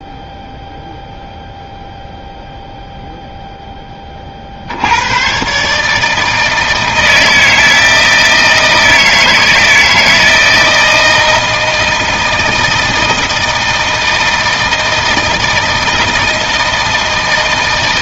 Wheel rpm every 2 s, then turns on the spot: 0, 0, 30, 160, 160, 160, 160, 160, 160.
none